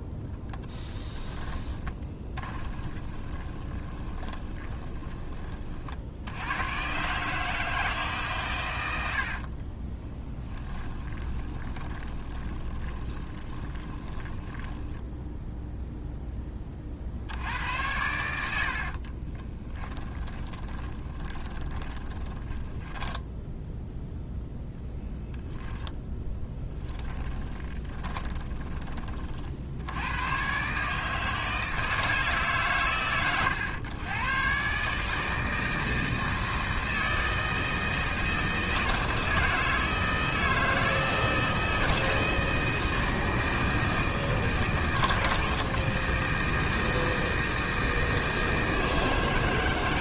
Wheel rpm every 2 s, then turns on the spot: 10, 20, 20, 110, 110, 20, 20, 10, 40, 60, 20, 10, 0, 10, 20, 140, 140, 140, 160, 160, 160, 160, 160, 160, 160.
2-6 10-16 18-24 26-28